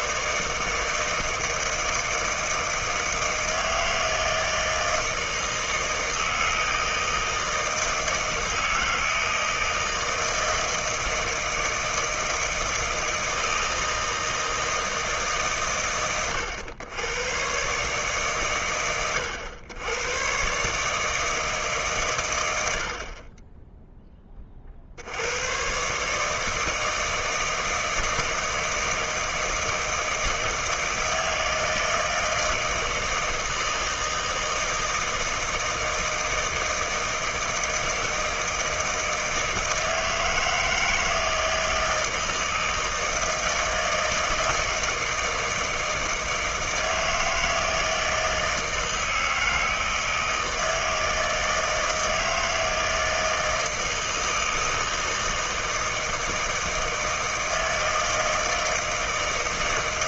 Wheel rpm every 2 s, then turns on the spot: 160, 160, 160, 160, 160, 160, 160, 160, 110, 100, 150, 80, 60, 160, 160, 160, 160, 160, 160, 160, 160, 160, 160, 160, 160, 160, 160, 160, 160, 160.
none